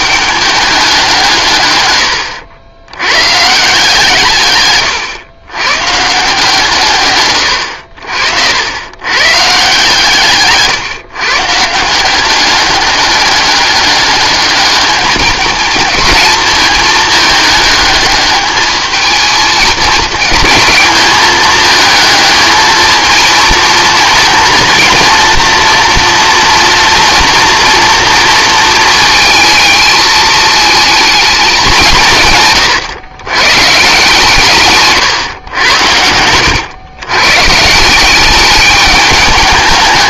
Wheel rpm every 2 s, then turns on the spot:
200, 100, 130, 150, 80, 140, 200, 210, 220, 220, 220, 220, 230, 230, 220, 220, 140, 140, 110, 200.
none